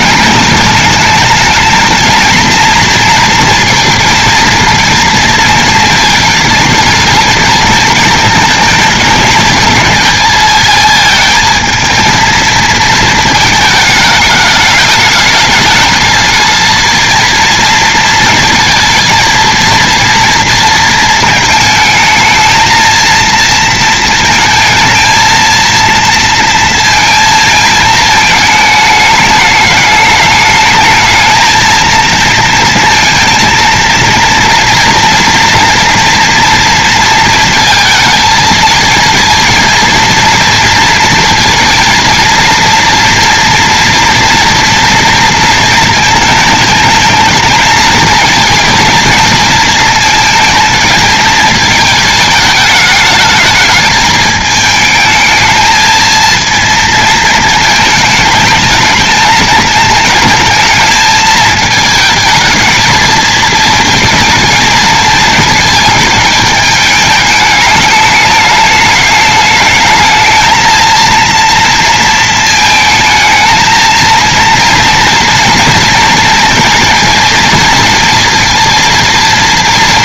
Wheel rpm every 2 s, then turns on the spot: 210, 240, 230, 220, 220, 220, 220, 210, 230, 220, 230, 230, 220, 230, 210, 220, 230, 240, 230, 230, 230, 230, 230, 220, 230, 230, 210, 220, 230, 210, 220, 220, 220, 210, 210, 230, 220, 240, 230, 230.
none